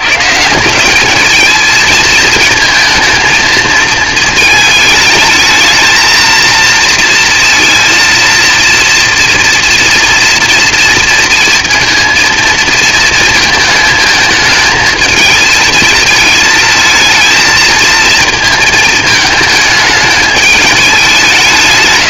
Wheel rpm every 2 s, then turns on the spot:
180, 230, 220, 230, 230, 230, 230, 220, 220, 230, 210.
none